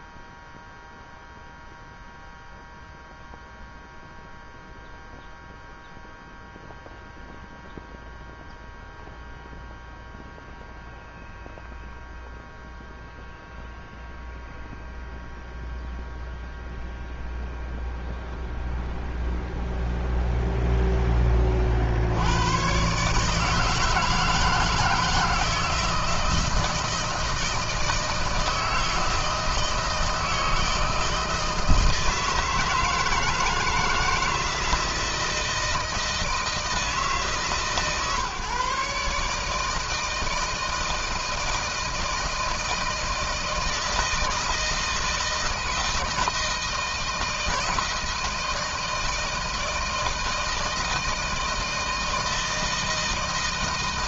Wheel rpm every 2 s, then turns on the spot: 0, 0, 0, 0, 0, 0, 0, 0, 0, 0, 10, 120, 160, 160, 160, 160, 160, 160, 160, 140, 160, 160, 160, 160, 160, 160, 160.
none